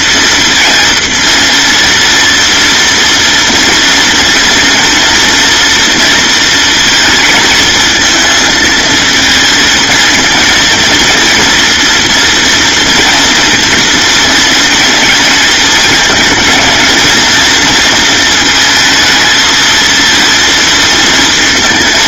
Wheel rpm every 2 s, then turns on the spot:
230, 230, 240, 230, 220, 230, 230, 230, 220, 220, 230.
none